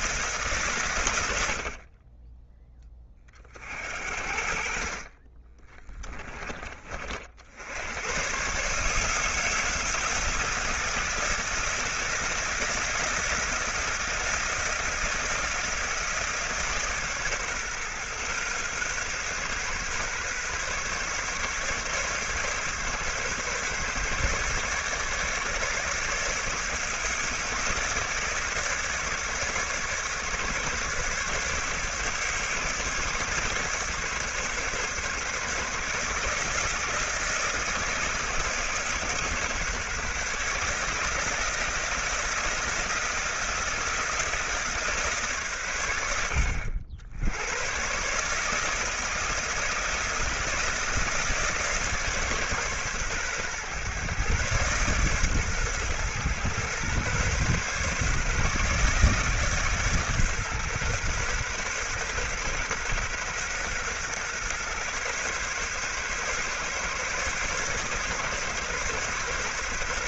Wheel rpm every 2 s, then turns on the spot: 100, 30, 30, 40, 150, 160, 160, 160, 140, 130, 140, 140, 140, 150, 150, 150, 150, 140, 160, 150, 160, 160, 150, 80, 160, 160, 130, 130, 130, 150, 130, 130, 130, 140, 130.
none